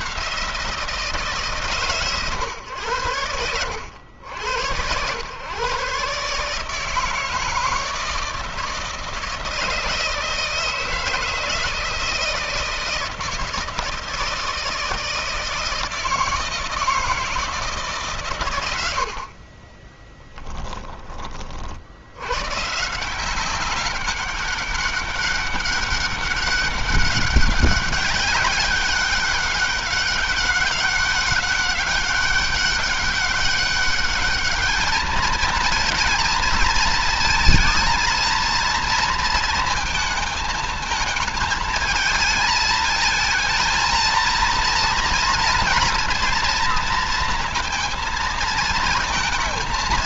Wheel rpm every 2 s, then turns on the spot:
170, 110, 90, 150, 160, 160, 160, 160, 160, 110, 20, 150, 200, 200, 200, 190, 200, 210, 230, 230, 220, 220, 230, 230, 230.
none